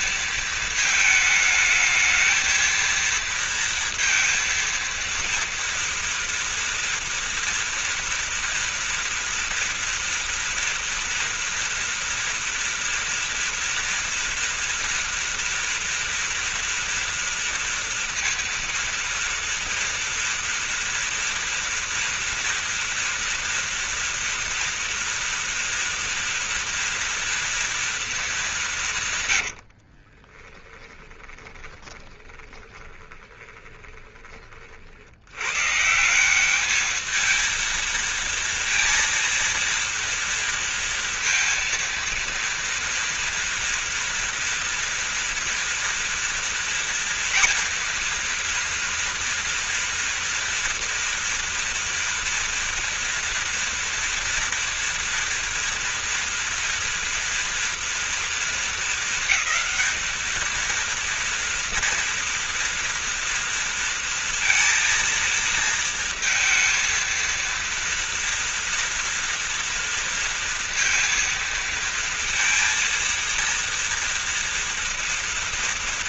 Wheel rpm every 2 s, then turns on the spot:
230, 220, 230, 230, 230, 240, 230, 230, 230, 230, 240, 240, 230, 230, 210, 30, 20, 30, 190, 230, 230, 230, 230, 230, 230, 230, 230, 230, 230, 230, 220, 230, 230, 230, 230, 230, 230, 230.
30-34